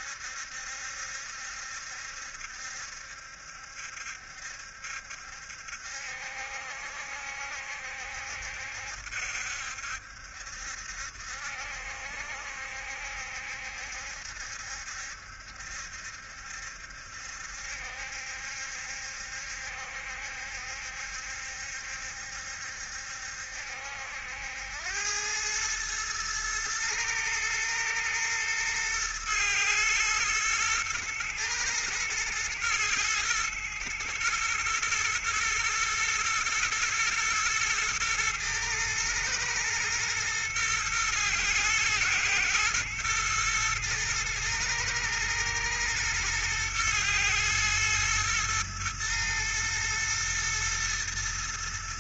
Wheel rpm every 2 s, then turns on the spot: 70, 70, 70, 70, 70, 70, 70, 70, 70, 70, 70, 70, 90, 110, 110, 120, 110, 120, 110, 110, 110, 110, 110, 120, 110, 120.
none